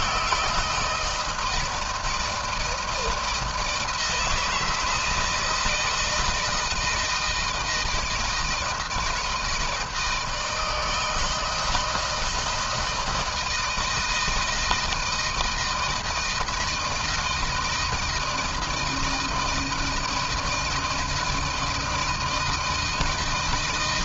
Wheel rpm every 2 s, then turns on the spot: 170, 160, 160, 160, 160, 160, 160, 160, 160, 160, 160, 160.
none